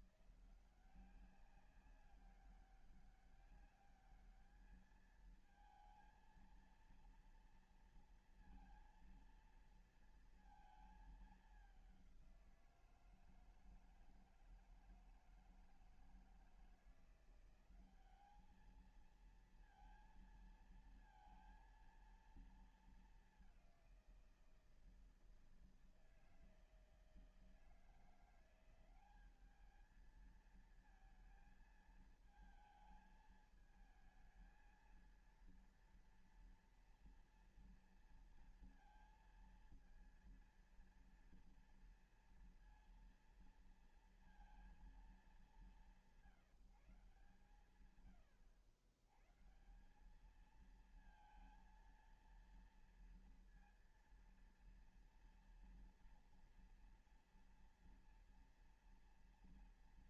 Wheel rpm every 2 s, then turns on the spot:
170, 200, 210, 230, 230, 220, 170, 160, 170, 220, 230, 220, 170, 160, 180, 220, 220, 220, 230, 230, 230, 230, 210, 160, 110, 220, 230, 230, 230, 230.
none